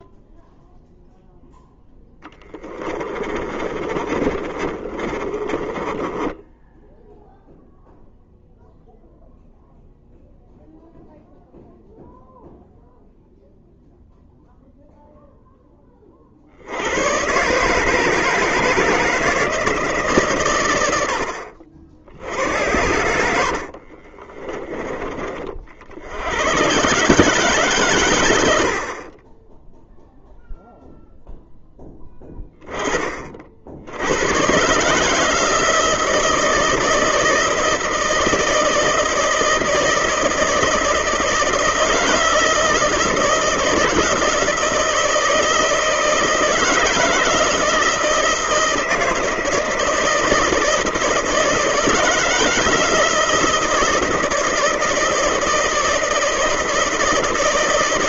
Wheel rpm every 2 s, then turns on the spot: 0, 20, 30, 0, 0, 0, 0, 0, 90, 160, 90, 90, 20, 130, 60, 0, 30, 150, 160, 160, 160, 160, 160, 160, 160, 160, 160, 160, 160.
2-6 22-24